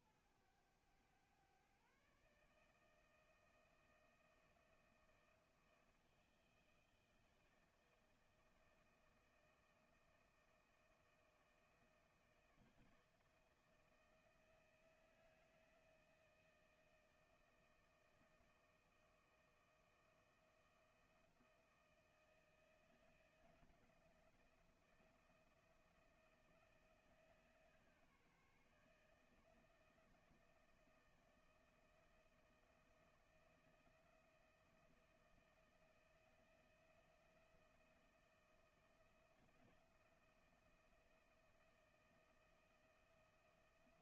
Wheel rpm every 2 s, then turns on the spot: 110, 150, 160, 160, 160, 160, 160, 160, 160, 160, 160, 160, 170, 170, 150, 160, 160, 160, 160, 170, 170, 160.
none